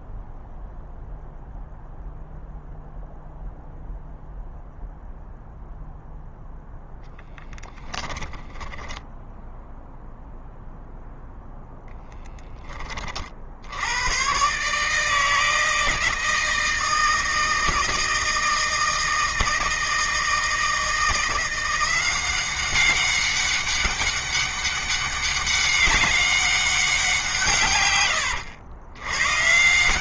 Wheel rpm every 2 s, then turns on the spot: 0, 0, 0, 0, 10, 0, 30, 150, 160, 160, 160, 190, 200, 190, 110.
8-10